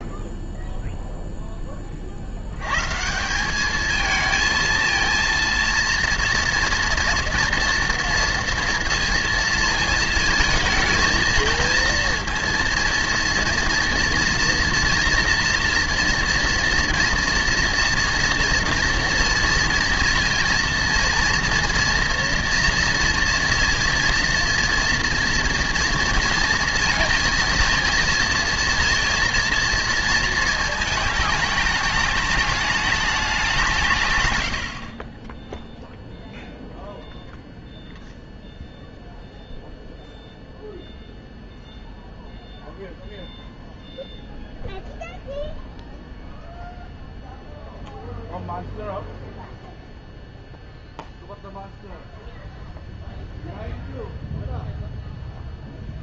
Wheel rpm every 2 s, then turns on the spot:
0, 90, 220, 230, 230, 220, 230, 230, 230, 230, 230, 230, 240, 230, 230, 230, 210, 90, 0, 0, 0, 0, 0, 0, 0, 0, 0, 0.
none